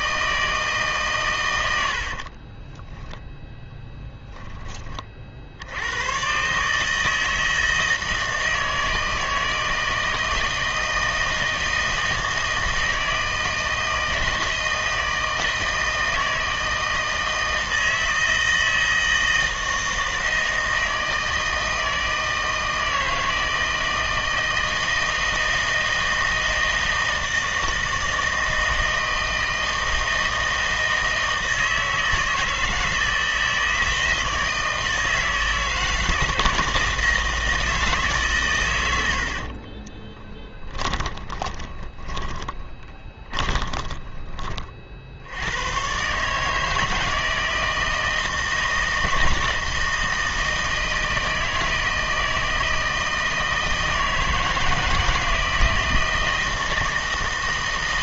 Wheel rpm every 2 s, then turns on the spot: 160, 10, 10, 120, 160, 160, 160, 160, 160, 160, 160, 160, 160, 160, 160, 160, 160, 160, 160, 150, 20, 20, 20, 130, 160, 160, 160, 160, 160.
2-4 40-46